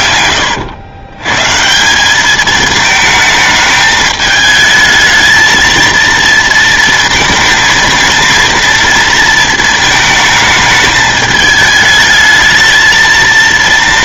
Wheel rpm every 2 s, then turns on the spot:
100, 220, 220, 230, 230, 220, 220.
none